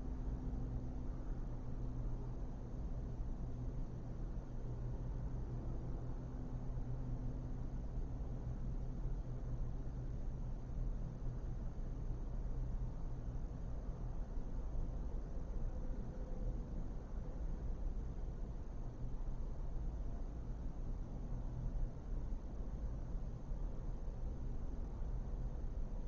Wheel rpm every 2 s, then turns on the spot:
0, 0, 0, 0, 0, 0, 0, 0, 0, 0, 0, 0, 0.
none